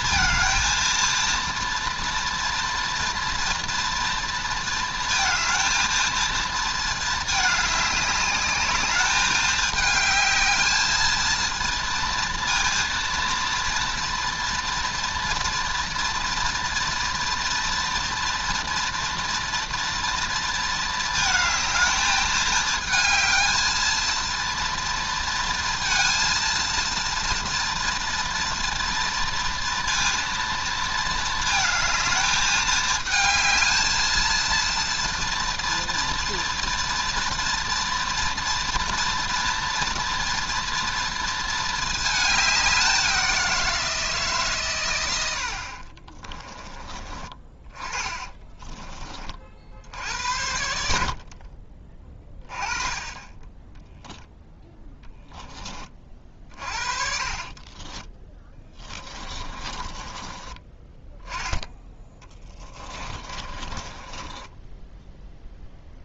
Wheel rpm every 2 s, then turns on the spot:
230, 240, 230, 220, 210, 220, 230, 230, 230, 230, 220, 220, 230, 230, 230, 230, 220, 230, 240, 230, 230, 190, 120, 20, 20, 70, 20, 0, 40, 20, 20, 20, 10.
48-50 56-60 62-66